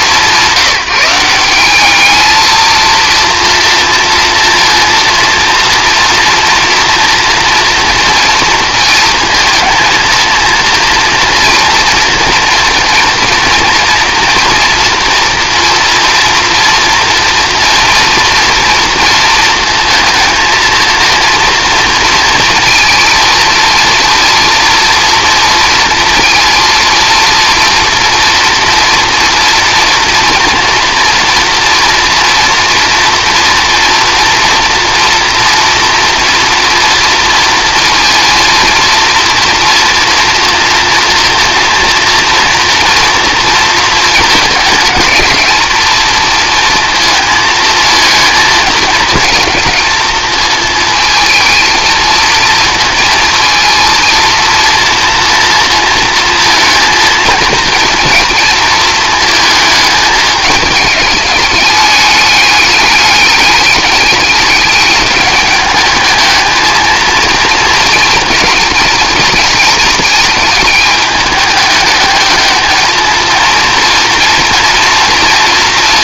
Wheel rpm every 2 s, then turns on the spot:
180, 230, 230, 230, 230, 230, 230, 230, 230, 230, 230, 230, 230, 230, 240, 230, 240, 230, 230, 230, 240, 230, 210, 230, 230, 220, 220, 230, 230, 220, 210, 200, 200, 220, 230, 210, 220, 230.
none